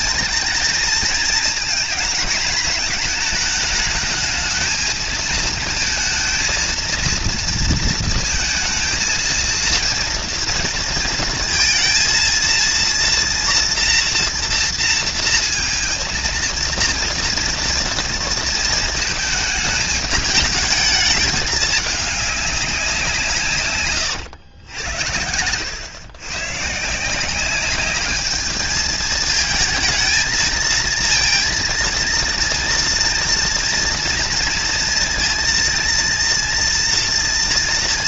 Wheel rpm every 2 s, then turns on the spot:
230, 220, 220, 230, 230, 230, 230, 230, 230, 230, 220, 190, 90, 140, 220, 220, 230, 230, 230.
none